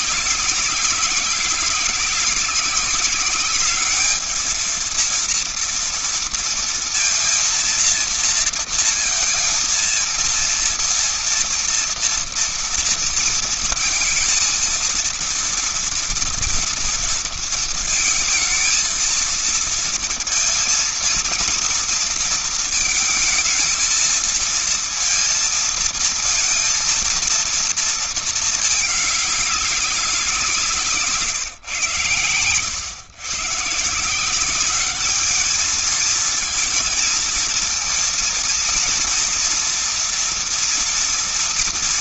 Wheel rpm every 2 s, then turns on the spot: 200, 190, 220, 230, 230, 230, 230, 230, 230, 230, 220, 230, 220, 230, 220, 180, 110, 180, 220, 230, 230.
none